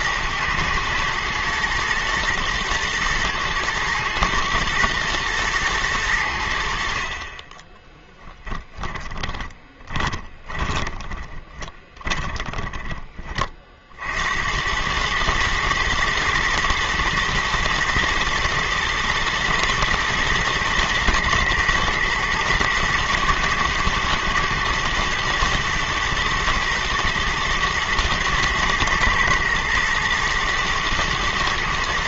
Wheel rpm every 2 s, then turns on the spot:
110, 120, 110, 40, 20, 20, 30, 110, 110, 120, 120, 110, 120, 120, 120, 120.
8-12